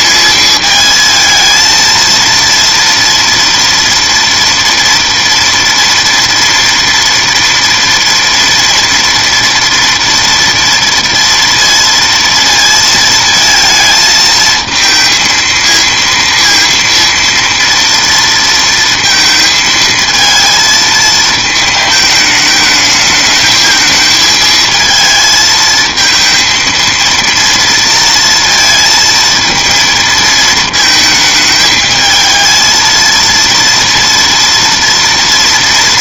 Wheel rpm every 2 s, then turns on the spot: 220, 230, 230, 240, 230, 230, 230, 230, 230, 230, 220, 210, 220, 230, 230, 220, 220, 230.
none